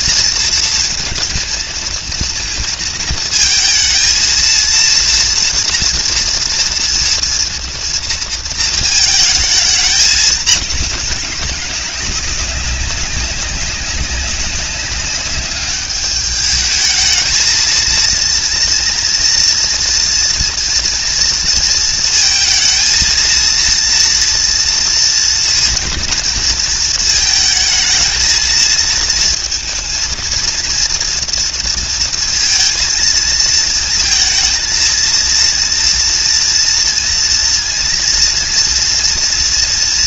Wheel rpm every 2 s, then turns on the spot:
220, 230, 230, 230, 230, 200, 200, 200, 210, 230, 230, 220, 230, 230, 230, 230, 230, 230, 230, 230.
none